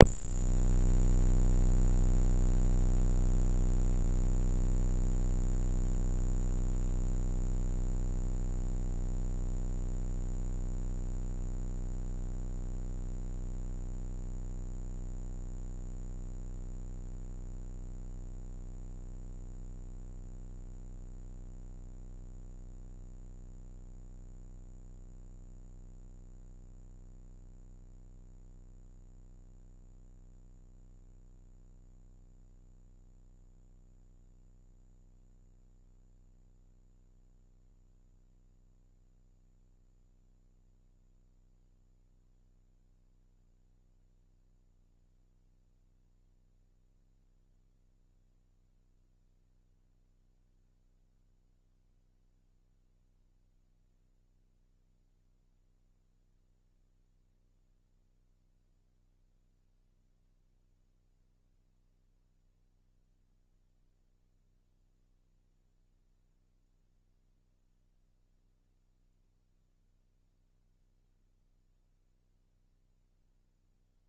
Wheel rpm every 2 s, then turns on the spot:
0, 0, 0, 0, 0, 0, 0, 0, 0, 0, 0, 0, 0, 0, 0, 0, 0, 0, 0, 0, 0, 0, 0, 0, 0, 0, 0, 0, 0, 0, 0, 0, 0, 0, 0, 0, 0.
none